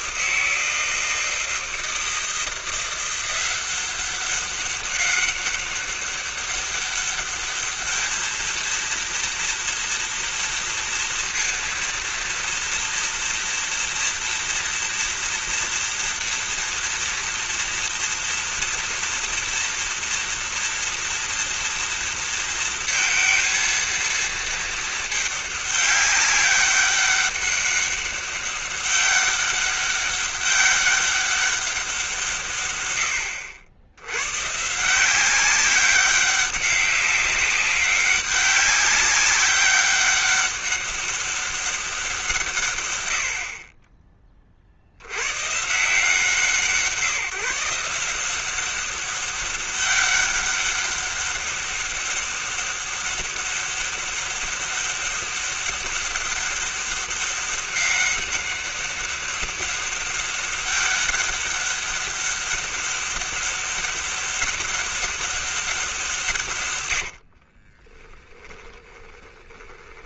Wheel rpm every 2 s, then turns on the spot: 160, 160, 190, 200, 220, 230, 230, 230, 230, 240, 230, 230, 230, 200, 200, 200, 160, 100, 190, 200, 200, 180, 30, 150, 170, 200, 200, 200, 200, 200, 200, 200, 200, 170, 20.
68-70